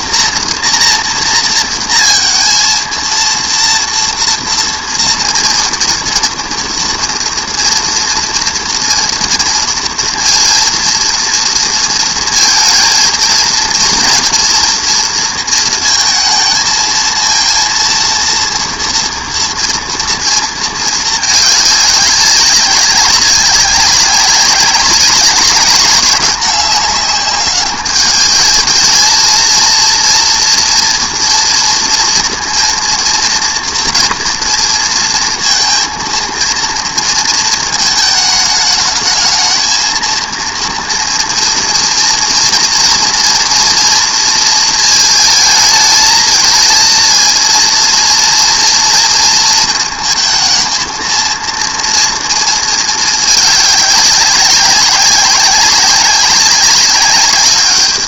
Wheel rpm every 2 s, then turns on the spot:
230, 230, 230, 240, 230, 230, 230, 230, 220, 230, 220, 200, 200, 200, 220, 230, 230, 230, 230, 210, 230, 230, 230, 230, 230, 230, 220, 190, 200.
none